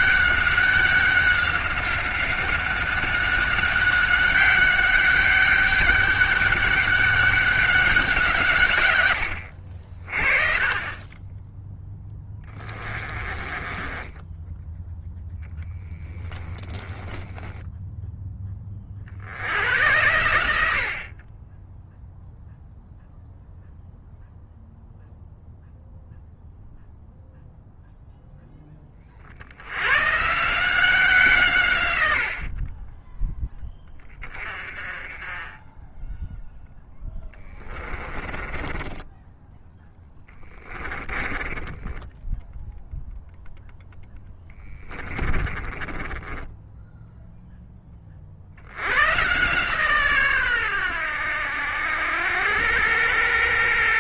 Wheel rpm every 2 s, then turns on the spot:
190, 190, 200, 200, 120, 30, 20, 10, 10, 40, 50, 0, 0, 0, 30, 170, 20, 20, 0, 20, 20, 0, 10, 10, 90, 100, 100.
12-14 16-18 38-42 44-46